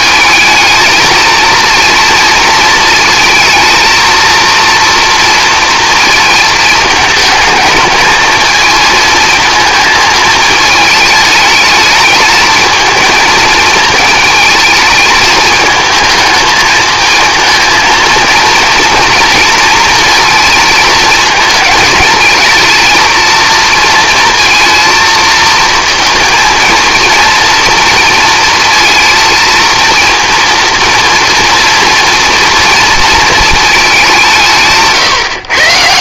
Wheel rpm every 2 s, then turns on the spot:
220, 220, 230, 220, 230, 220, 220, 220, 220, 230, 220, 230, 230, 230, 230, 230, 230, 170.
none